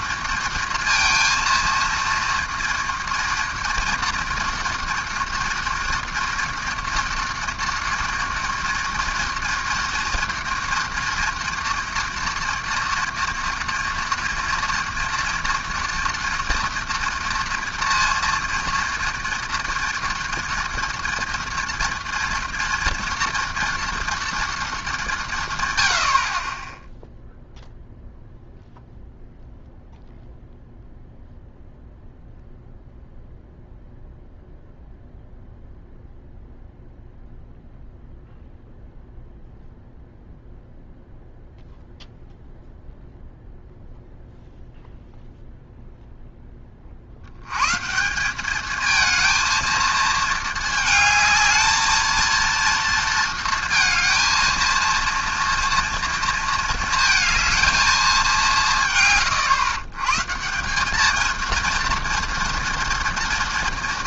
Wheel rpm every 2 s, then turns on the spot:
230, 240, 230, 230, 240, 230, 230, 230, 230, 230, 230, 230, 210, 10, 0, 0, 0, 0, 0, 0, 0, 0, 0, 20, 210, 220, 230, 230, 230, 160, 190, 230.
none